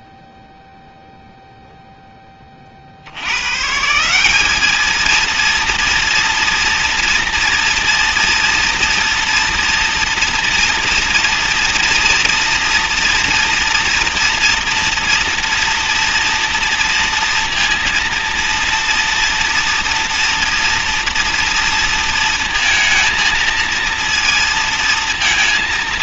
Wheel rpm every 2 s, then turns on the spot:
0, 0, 170, 230, 230, 230, 230, 230, 230, 230, 240, 230, 230.
none